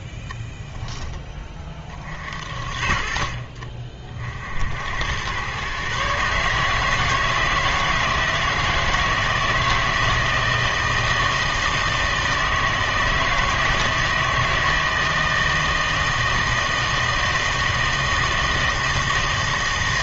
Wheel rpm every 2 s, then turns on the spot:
10, 40, 80, 150, 160, 160, 160, 160, 160, 160.
none